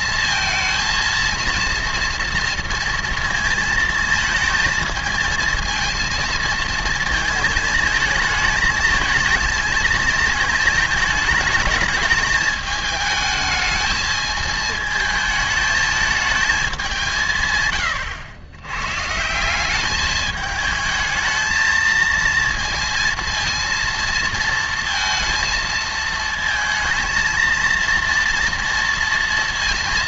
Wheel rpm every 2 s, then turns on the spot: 230, 230, 230, 230, 220, 220, 210, 220, 180, 140, 220, 230, 230, 230, 230.
none